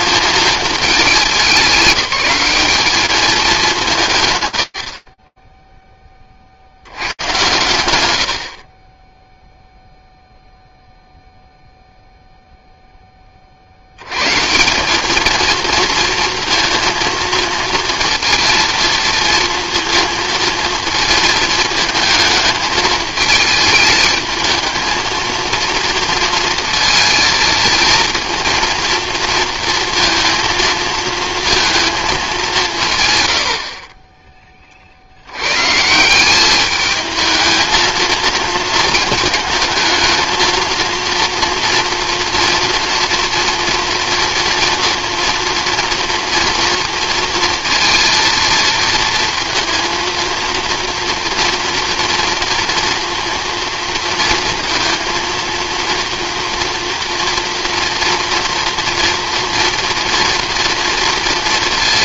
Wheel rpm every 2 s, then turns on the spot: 210, 200, 80, 90, 30, 0, 10, 200, 230, 230, 220, 220, 230, 230, 230, 230, 120, 90, 220, 220, 230, 230, 230, 230, 230, 230, 230, 230, 240, 230, 230.
none